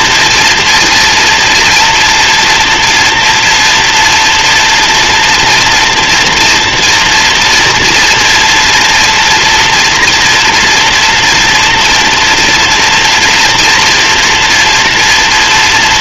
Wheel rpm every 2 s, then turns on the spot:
230, 230, 240, 230, 240, 230, 230, 230.
none